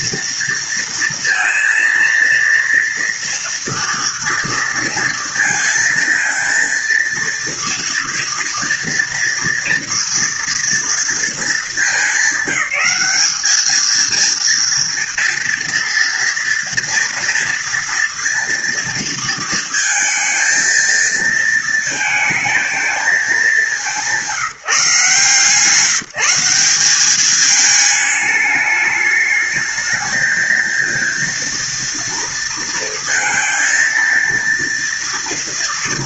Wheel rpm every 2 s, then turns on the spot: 230, 230, 230, 230, 230, 230, 200, 230, 230, 230, 230, 230, 180, 180, 210, 220, 230, 230.
none